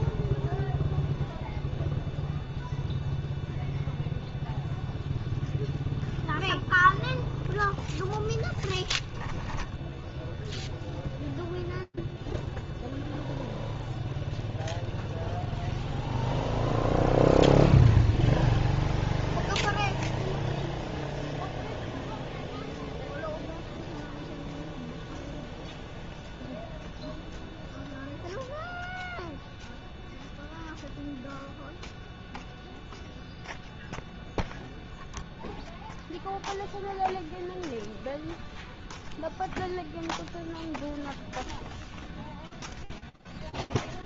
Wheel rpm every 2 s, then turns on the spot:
0, 0, 0, 0, 10, 0, 0, 0, 0, 0, 0, 0, 0, 0, 0, 0, 0, 0, 0, 0, 0, 0.
none